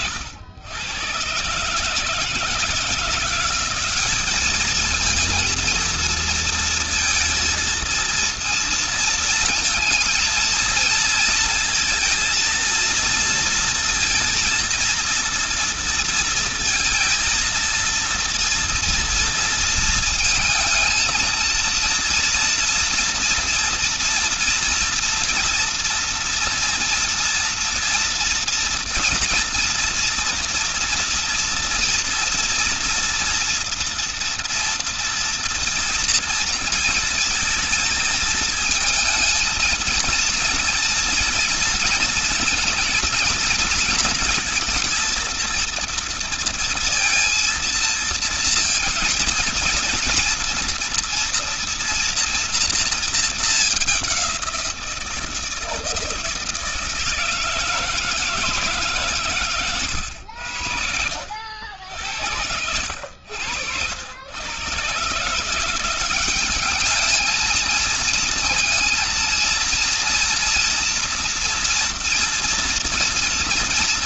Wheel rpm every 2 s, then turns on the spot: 110, 170, 220, 230, 230, 230, 230, 230, 230, 230, 230, 230, 240, 230, 230, 240, 230, 230, 230, 230, 230, 230, 230, 230, 230, 230, 230, 170, 160, 140, 70, 80, 130, 210, 230, 230, 230.
none